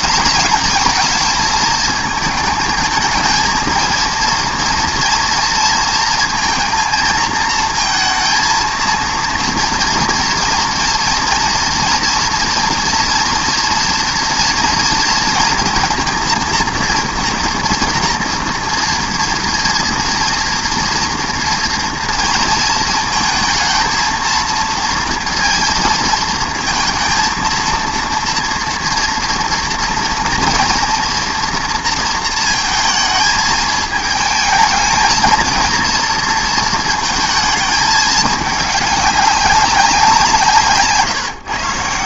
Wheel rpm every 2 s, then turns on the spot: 210, 220, 230, 230, 230, 240, 230, 230, 230, 230, 230, 230, 230, 220, 230, 230, 220, 220, 230, 210, 160.
none